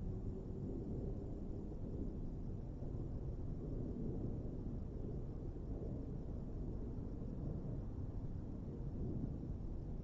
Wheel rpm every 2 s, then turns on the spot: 0, 0, 0, 0, 0.
none